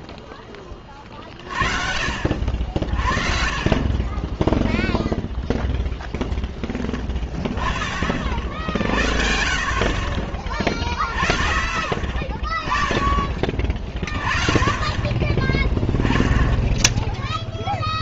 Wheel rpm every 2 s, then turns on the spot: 10, 60, 10, 0, 50, 30, 20, 20, 10.
none